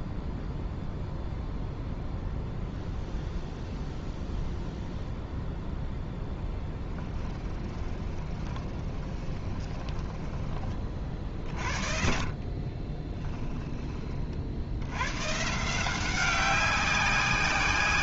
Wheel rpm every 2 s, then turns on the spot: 0, 0, 0, 10, 20, 30, 30, 90, 190.
6-10 12-14